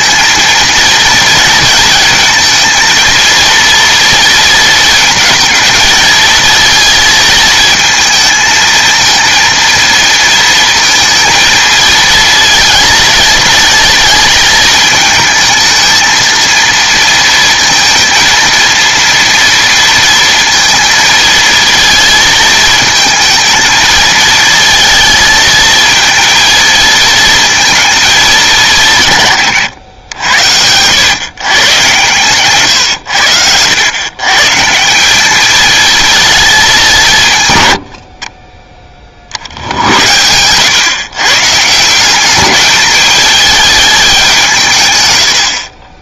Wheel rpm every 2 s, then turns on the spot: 230, 230, 230, 230, 230, 230, 220, 220, 230, 230, 230, 220, 230, 220, 160, 100, 110, 160, 200, 30, 130, 210, 140.
none